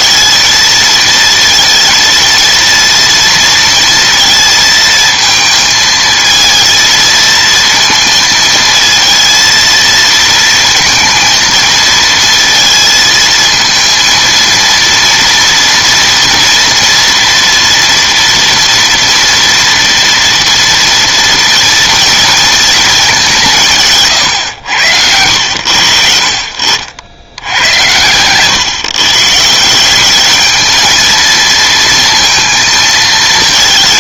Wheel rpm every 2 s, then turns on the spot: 230, 230, 230, 230, 230, 230, 230, 230, 230, 230, 230, 220, 90, 70, 140, 220, 220.
none